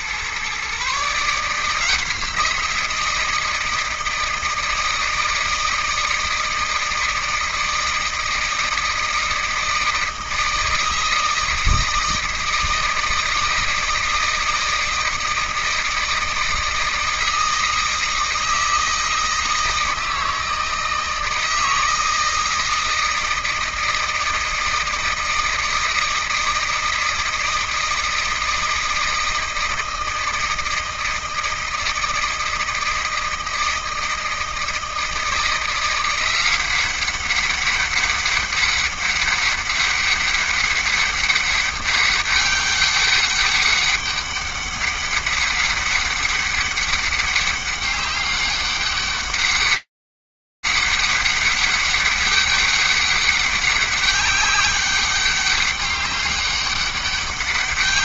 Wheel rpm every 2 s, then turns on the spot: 140, 170, 160, 160, 160, 160, 160, 160, 160, 160, 160, 160, 160, 160, 160, 160, 160, 160, 190, 200, 200, 200, 200, 200, 200, 200, 200, 200, 200.
none